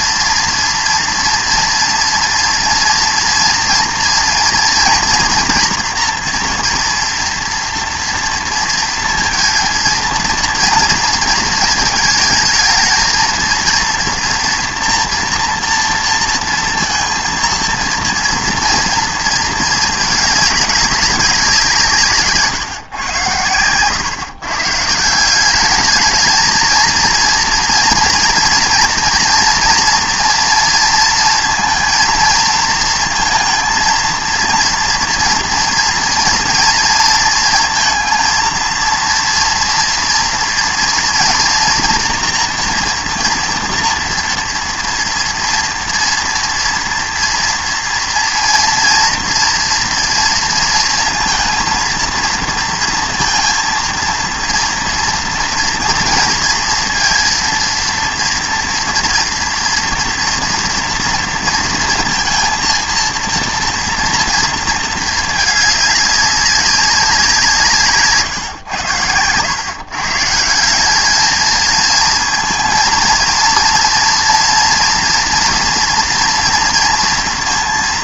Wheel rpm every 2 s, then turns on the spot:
230, 230, 230, 240, 230, 230, 220, 230, 230, 230, 210, 140, 140, 230, 230, 230, 230, 230, 230, 230, 230, 230, 240, 240, 230, 230, 230, 230, 230, 230, 230, 230, 230, 190, 120, 180, 230, 230, 230.
none